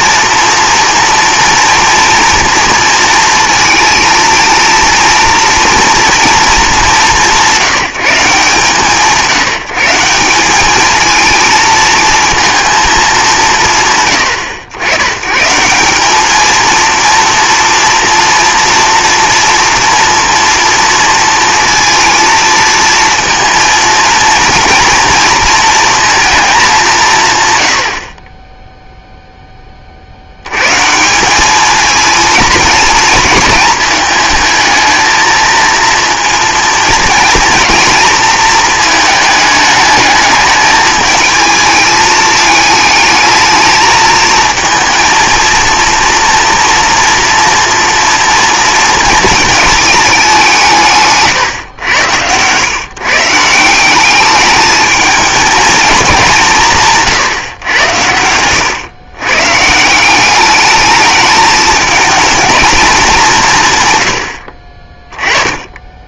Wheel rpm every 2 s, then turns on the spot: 230, 230, 230, 210, 150, 200, 230, 110, 230, 230, 230, 230, 230, 190, 0, 140, 230, 220, 230, 230, 220, 220, 230, 230, 230, 160, 120, 210, 170, 120, 210, 220, 40.
64-66